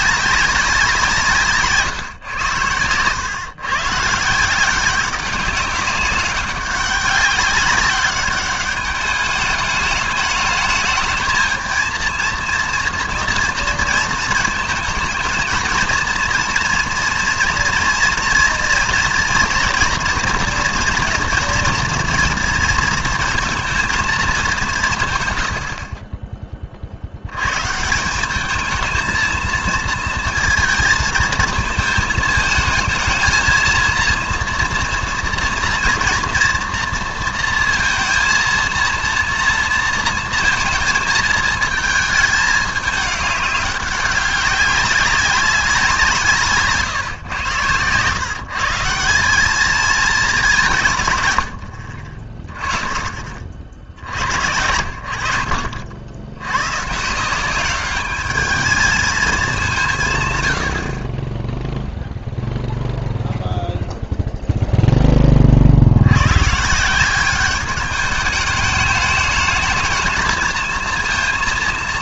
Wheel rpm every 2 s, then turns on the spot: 190, 110, 180, 190, 210, 210, 230, 220, 240, 230, 230, 230, 190, 30, 220, 220, 220, 230, 230, 230, 230, 210, 200, 140, 170, 180, 20, 70, 110, 210, 80, 0, 0, 150, 210, 230.
none